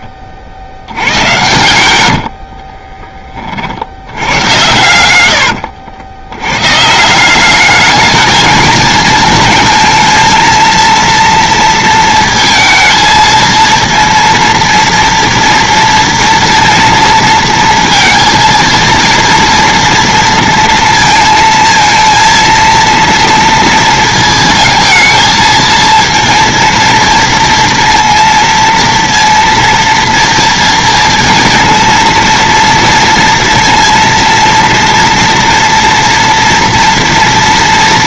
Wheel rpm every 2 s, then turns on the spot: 20, 60, 100, 100, 220, 230, 230, 230, 230, 230, 230, 230, 220, 230, 230, 230, 230, 230, 230.
2-4